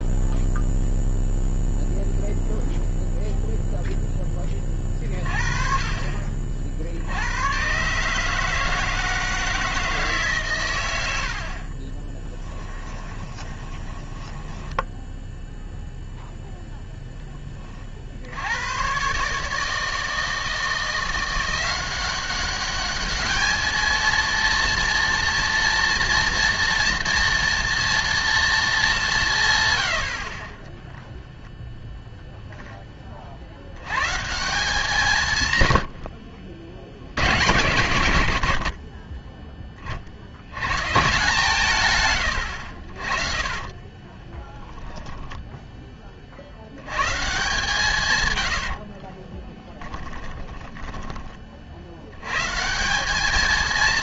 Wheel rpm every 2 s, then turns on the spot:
0, 0, 30, 50, 160, 110, 10, 10, 0, 100, 170, 200, 230, 230, 210, 20, 10, 170, 70, 60, 120, 70, 20, 90, 60, 10, 180.
12-14 44-46 48-50